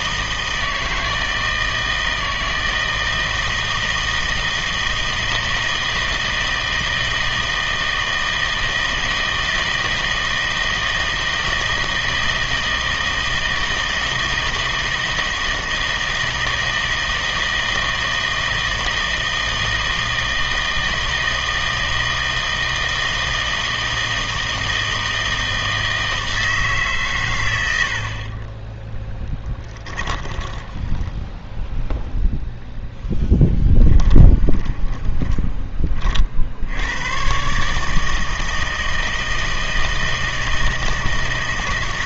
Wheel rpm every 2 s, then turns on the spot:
160, 160, 160, 160, 160, 160, 160, 160, 160, 160, 160, 160, 160, 150, 10, 20, 0, 10, 70, 160, 160.
28-32 34-36